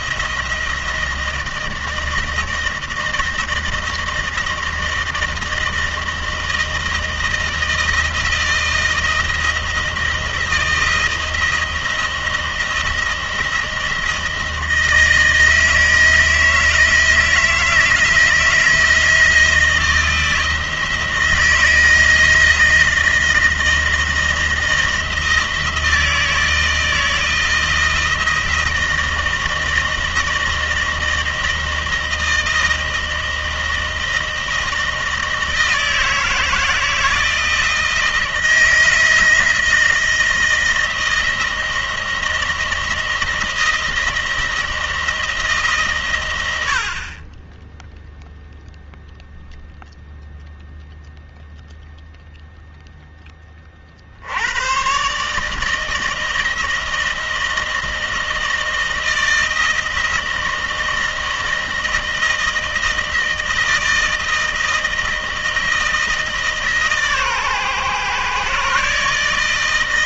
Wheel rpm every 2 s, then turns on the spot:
160, 160, 160, 160, 160, 160, 160, 160, 160, 160, 160, 160, 160, 160, 160, 160, 160, 160, 160, 160, 160, 160, 170, 90, 0, 0, 0, 110, 160, 160, 160, 160, 160, 150, 140.
none